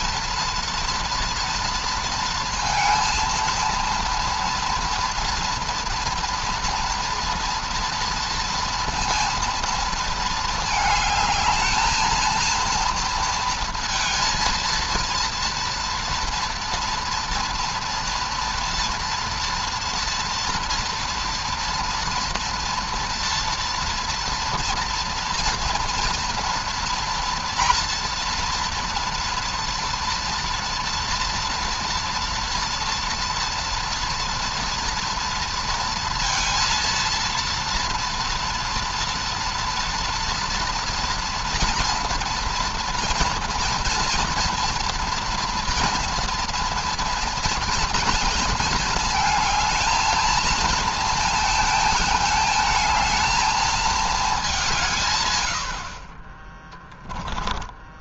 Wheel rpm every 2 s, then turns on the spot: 230, 230, 230, 240, 230, 220, 230, 230, 230, 230, 230, 230, 230, 230, 240, 230, 230, 230, 230, 230, 230, 230, 230, 230, 220, 220, 220, 190, 20.
none